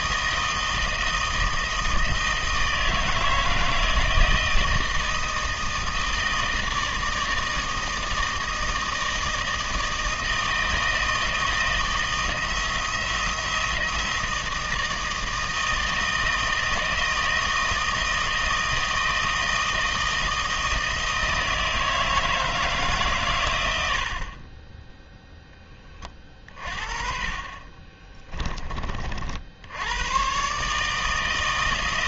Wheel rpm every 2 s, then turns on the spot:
160, 160, 160, 160, 160, 160, 160, 160, 160, 160, 160, 150, 10, 30, 30, 150.
24-26